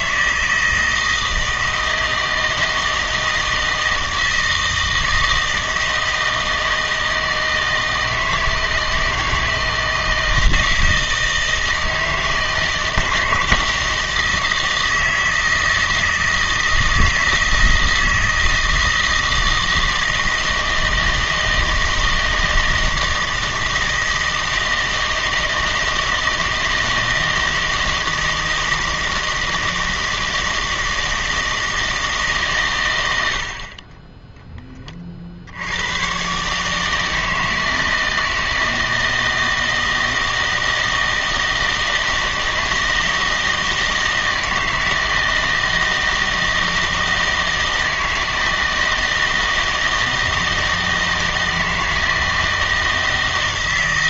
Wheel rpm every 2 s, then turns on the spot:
160, 160, 160, 160, 160, 160, 160, 160, 160, 160, 160, 160, 160, 160, 160, 160, 130, 10, 140, 160, 160, 160, 160, 160, 160, 160, 160.
none